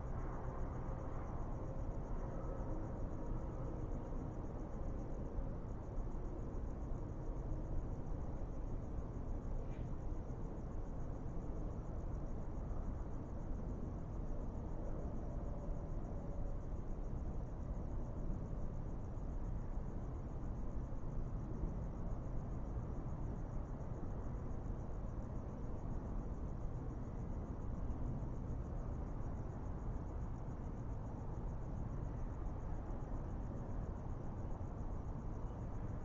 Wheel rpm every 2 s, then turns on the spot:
0, 0, 0, 0, 0, 0, 0, 0, 0, 0, 0, 0, 0, 0, 0, 0, 0, 0.
none